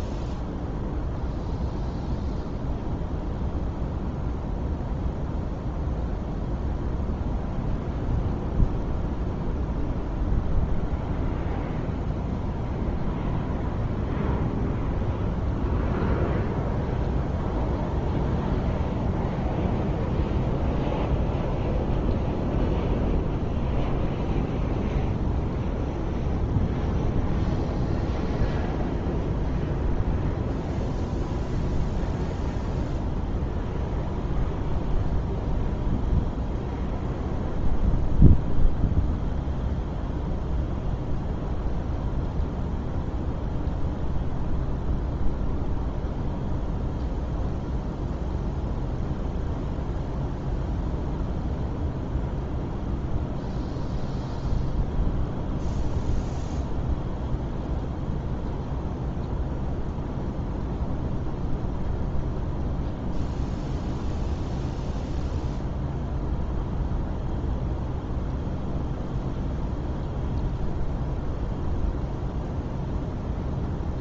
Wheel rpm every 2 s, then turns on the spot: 0, 0, 0, 0, 0, 0, 0, 0, 0, 0, 0, 0, 0, 0, 0, 0, 0, 0, 0, 0, 0, 0, 0, 0, 0, 0, 0, 0, 0, 0, 0, 0, 0, 0, 0, 0, 0.
none